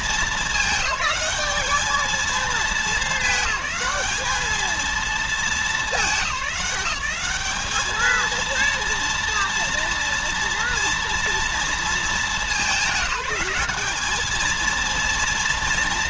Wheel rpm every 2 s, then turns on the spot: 210, 220, 220, 200, 230, 240, 190, 220.
none